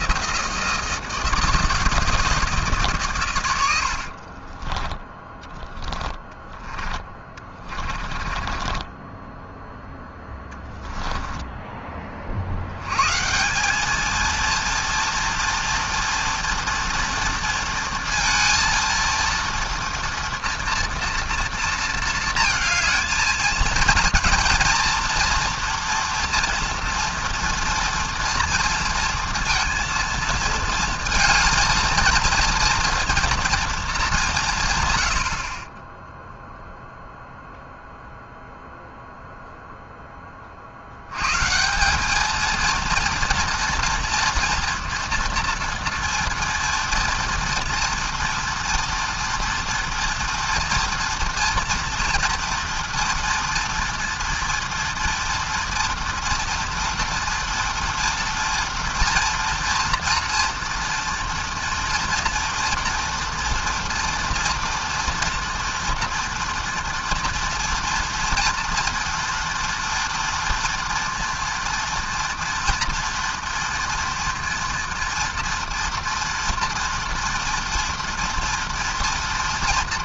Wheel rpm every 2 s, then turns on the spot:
160, 150, 20, 20, 10, 10, 100, 230, 230, 230, 230, 220, 230, 230, 230, 220, 230, 120, 0, 0, 70, 230, 230, 240, 230, 230, 230, 230, 240, 230, 230, 230, 230, 230, 230, 240, 240, 240, 240, 230.
4-12